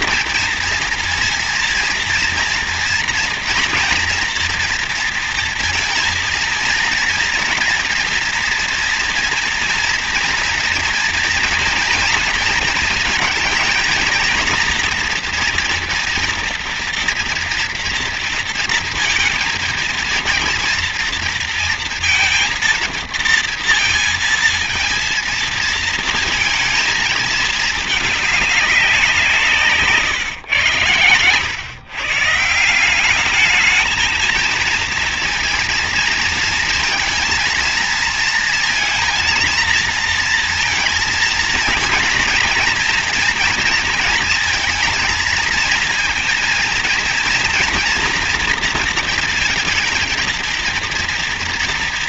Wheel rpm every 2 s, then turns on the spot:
230, 230, 230, 230, 230, 230, 230, 230, 240, 230, 230, 230, 230, 230, 200, 110, 160, 230, 230, 230, 230, 230, 230, 230, 230, 220.
none